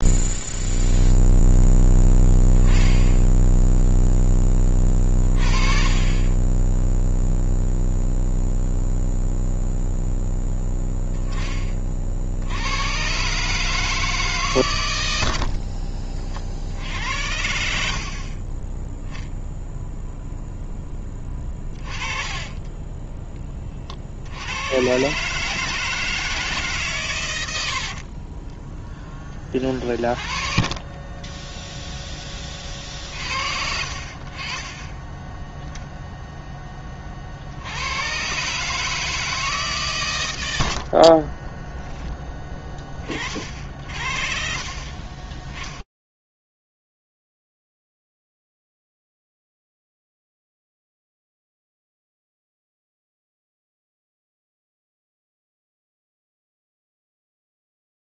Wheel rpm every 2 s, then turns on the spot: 0, 10, 20, 0, 0, 10, 120, 100, 70, 0, 10, 10, 130, 130, 10, 20, 60, 10, 40, 150, 60, 30, 30, 0, 0, 0, 20, 0, 0.
20-22 30-32 34-36 40-42 44-46